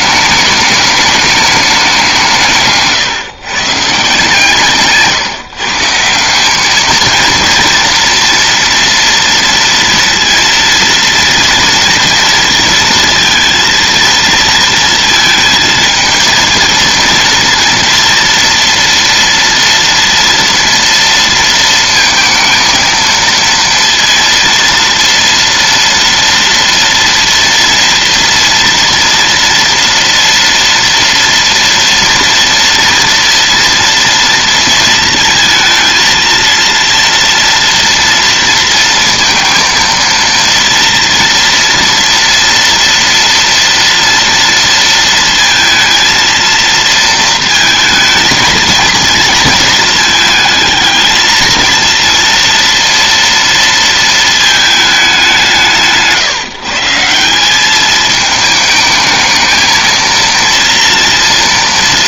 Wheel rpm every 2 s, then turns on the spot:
210, 160, 150, 190, 230, 230, 230, 230, 220, 230, 230, 220, 230, 230, 230, 230, 240, 230, 230, 230, 230, 230, 230, 230, 230, 220, 230, 220, 150, 210, 230.
none